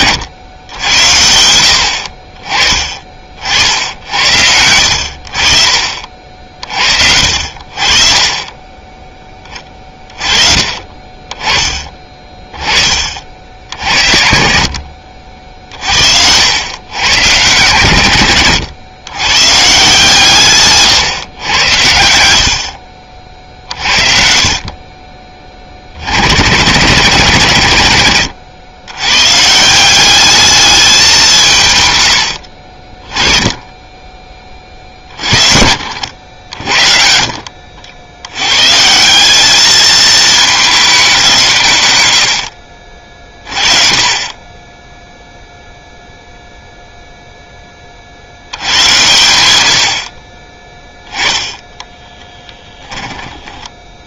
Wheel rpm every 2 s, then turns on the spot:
90, 40, 80, 50, 20, 30, 40, 60, 110, 110, 140, 60, 30, 110, 100, 210, 30, 40, 60, 160, 200, 50, 10, 0, 100, 10, 10.
20-22 52-54